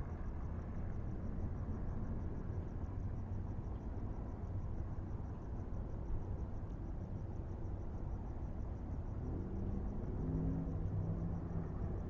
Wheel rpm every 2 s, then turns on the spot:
0, 0, 0, 0, 0, 0.
none